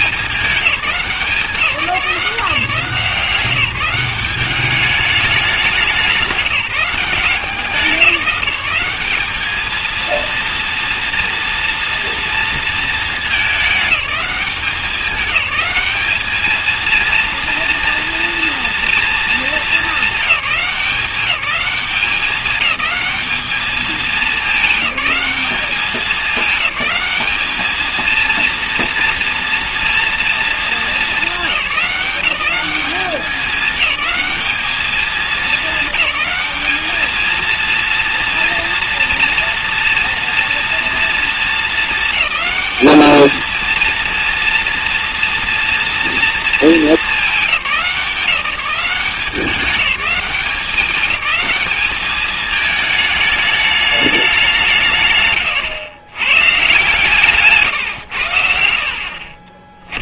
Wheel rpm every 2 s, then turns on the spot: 200, 170, 200, 200, 190, 240, 230, 190, 220, 240, 190, 210, 200, 210, 230, 220, 200, 210, 210, 240, 240, 210, 230, 220, 190, 200, 210, 180, 140, 60.
none